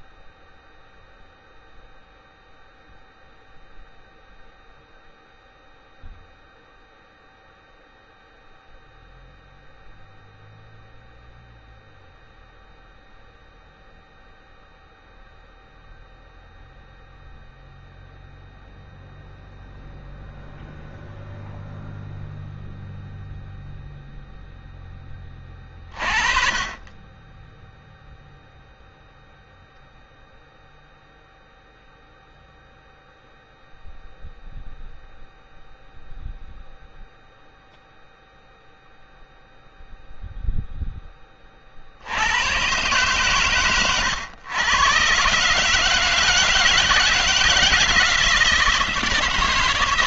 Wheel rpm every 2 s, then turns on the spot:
0, 0, 0, 0, 0, 0, 0, 0, 0, 0, 0, 0, 0, 30, 0, 0, 0, 0, 0, 0, 0, 90, 110, 160, 160.
none